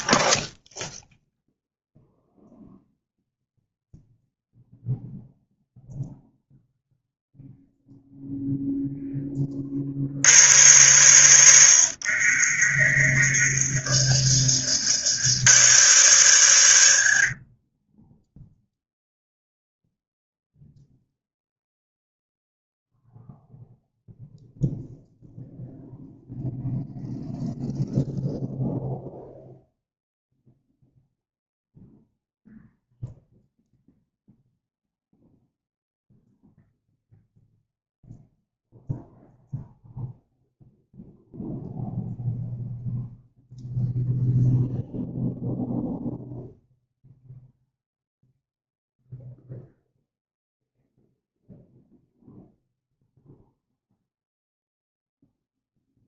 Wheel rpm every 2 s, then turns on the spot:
0, 0, 0, 0, 10, 100, 50, 80, 80, 0, 0, 0, 0, 0, 0, 0, 0, 0, 0, 0, 0, 0, 0, 0, 0, 0, 0, 0.
12-14